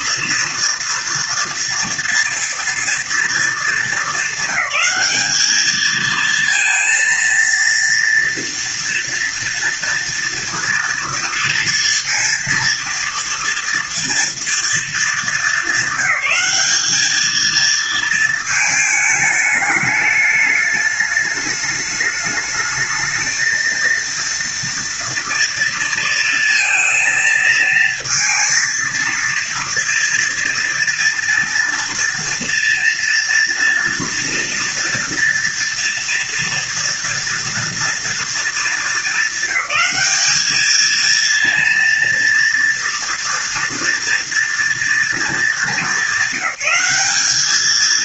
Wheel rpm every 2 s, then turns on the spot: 240, 230, 210, 230, 230, 230, 230, 220, 210, 220, 210, 220, 230, 230, 230, 230, 230, 230, 240, 210, 220, 230, 230, 200.
none